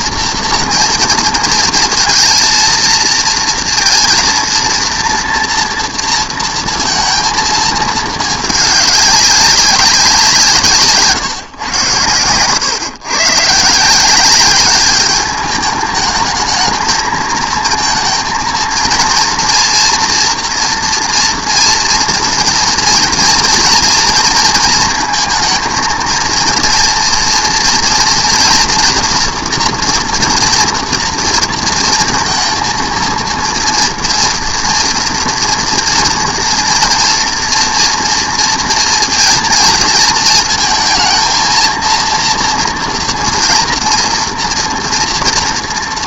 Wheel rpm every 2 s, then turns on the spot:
230, 230, 230, 230, 210, 160, 120, 200, 220, 230, 230, 230, 230, 230, 230, 230, 230, 230, 230, 230, 220, 230, 230.
none